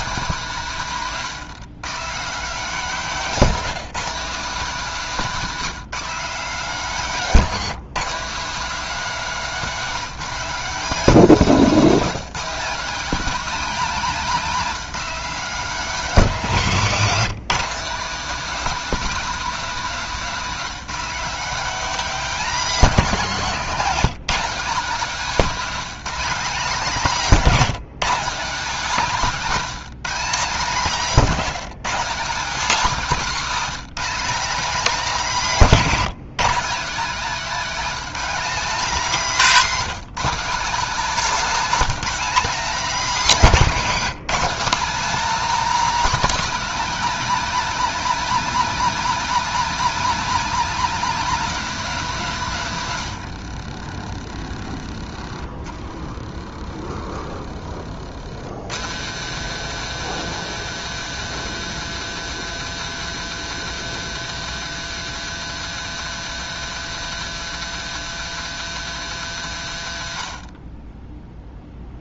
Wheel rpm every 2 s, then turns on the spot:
170, 230, 220, 220, 240, 220, 240, 250, 210, 250, 240, 230, 220, 240, 220, 220, 230, 250, 240, 250, 250, 250, 260, 290, 290, 270, 130, 30, 40, 130, 180, 180, 180, 180, 170, 20.
52-54